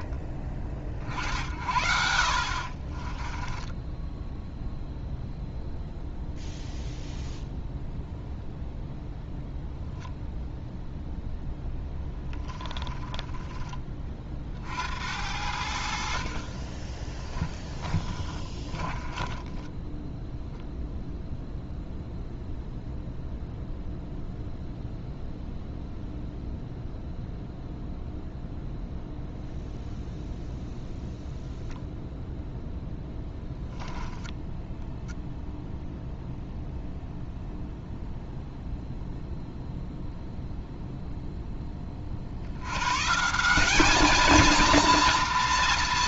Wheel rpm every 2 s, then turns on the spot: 50, 30, 0, 0, 0, 0, 10, 70, 20, 20, 0, 0, 0, 0, 0, 0, 0, 0, 0, 0, 0, 120, 230.
2-4 12-14 16-20